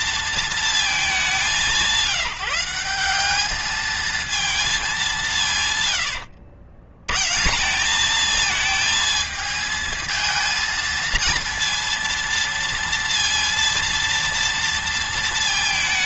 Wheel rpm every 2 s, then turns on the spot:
210, 190, 190, 90, 220, 230, 230, 230.
none